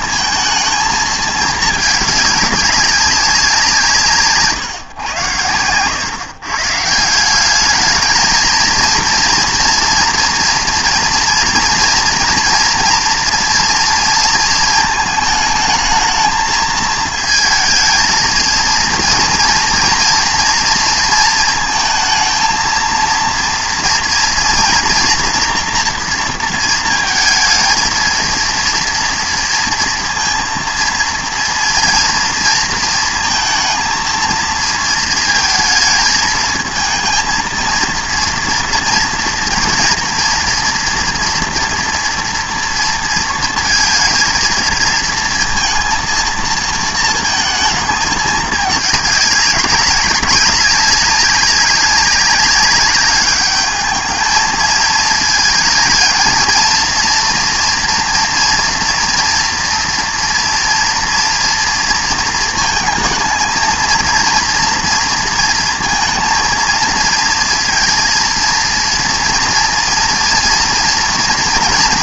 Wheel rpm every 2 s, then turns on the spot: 220, 200, 130, 140, 220, 240, 230, 230, 220, 230, 230, 230, 230, 230, 230, 230, 230, 230, 220, 230, 230, 230, 220, 230, 210, 200, 200, 220, 230, 230, 230, 220, 240, 230, 230, 230.
none